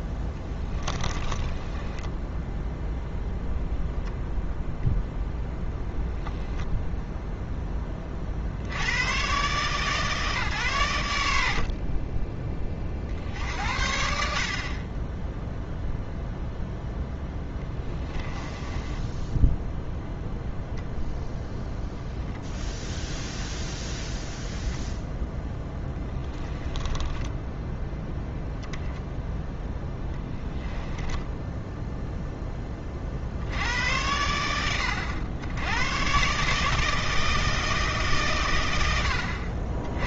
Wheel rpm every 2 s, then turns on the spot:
20, 0, 0, 0, 80, 110, 40, 30, 0, 10, 0, 0, 10, 10, 10, 10, 20, 90, 150, 100.
0-2 18-20 26-28 30-32